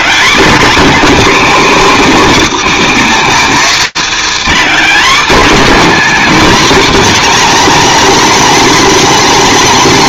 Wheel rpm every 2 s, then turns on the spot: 280, 270, 280, 270, 290.
none